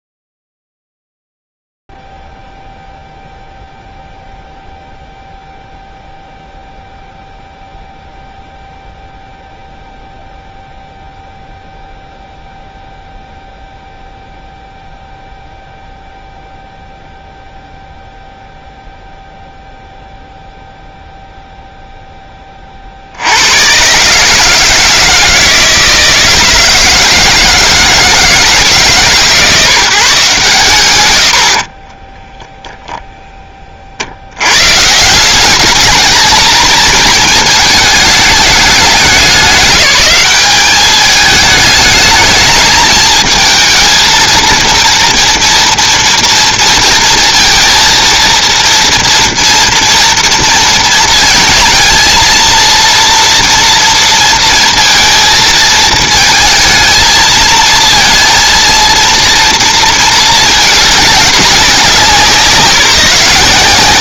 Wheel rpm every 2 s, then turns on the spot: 0, 0, 0, 0, 0, 0, 0, 0, 0, 0, 0, 30, 160, 160, 160, 130, 0, 120, 220, 210, 200, 220, 230, 230, 230, 220, 230, 230, 220, 230, 210, 180.
none